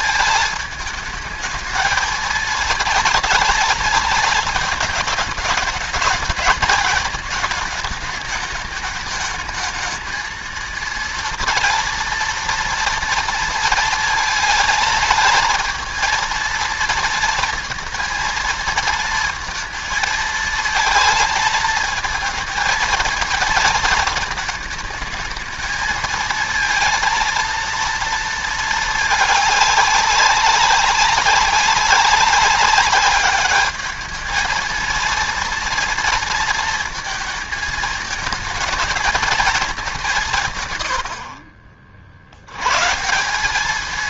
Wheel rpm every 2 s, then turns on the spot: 220, 230, 220, 220, 210, 230, 230, 220, 230, 230, 220, 230, 220, 230, 220, 200, 200, 220, 230, 220, 130, 110.
none